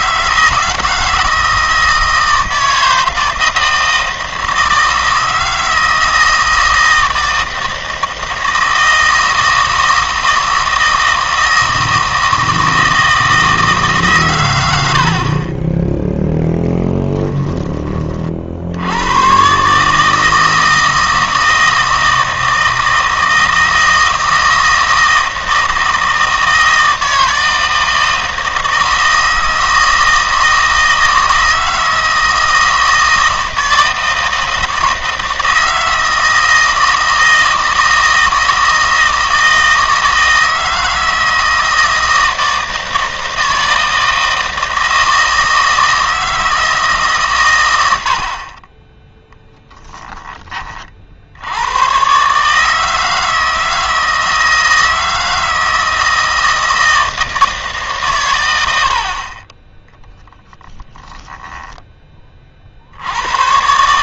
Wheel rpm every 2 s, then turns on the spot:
170, 160, 160, 160, 160, 160, 160, 90, 10, 70, 160, 160, 160, 160, 160, 160, 160, 160, 160, 160, 160, 160, 160, 160, 20, 40, 160, 160, 160, 80, 20, 60.
16-18 58-62